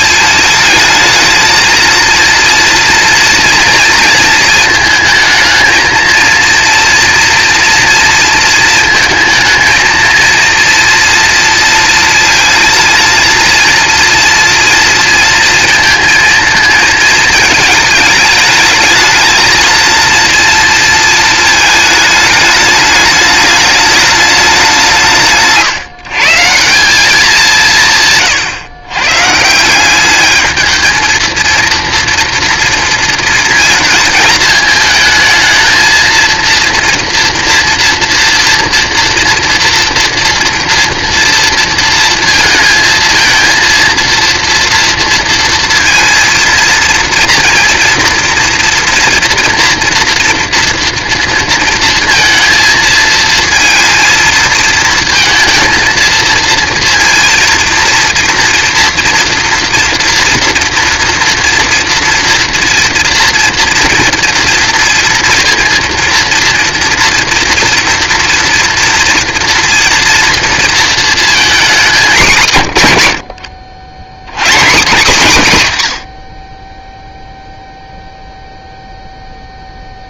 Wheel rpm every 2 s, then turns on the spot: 220, 230, 230, 240, 220, 230, 230, 230, 220, 220, 230, 210, 180, 190, 120, 220, 230, 220, 240, 230, 230, 230, 230, 230, 230, 230, 230, 230, 240, 230, 240, 230, 230, 230, 230, 230, 110, 170, 10, 0.
none